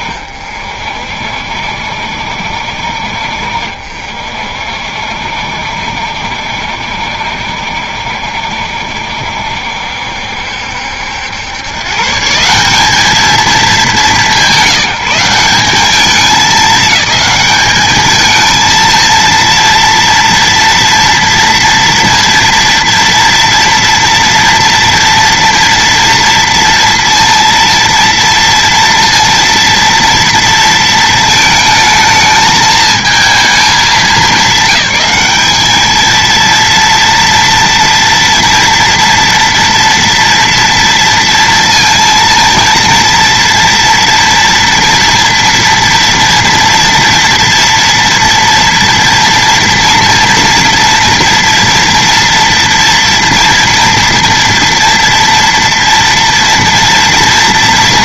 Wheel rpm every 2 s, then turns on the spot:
50, 60, 60, 70, 70, 70, 170, 170, 210, 220, 230, 230, 230, 230, 230, 230, 220, 210, 230, 230, 230, 230, 230, 230, 230, 230, 240, 230, 230.
none